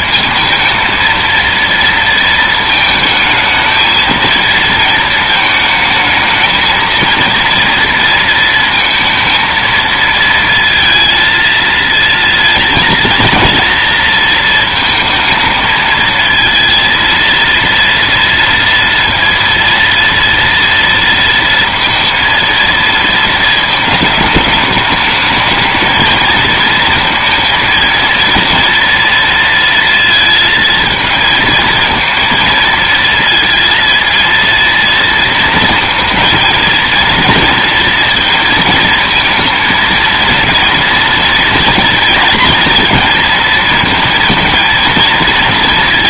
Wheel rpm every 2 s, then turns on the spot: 230, 220, 230, 220, 230, 230, 230, 220, 230, 230, 230, 230, 220, 220, 230, 230, 230, 230, 220, 220, 230, 230, 230.
none